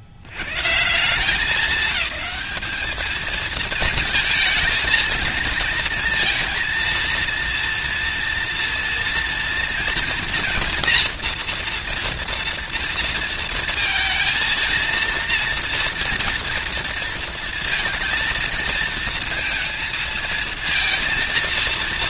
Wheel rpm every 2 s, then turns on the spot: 90, 210, 220, 230, 230, 240, 240, 230, 230, 220, 230.
none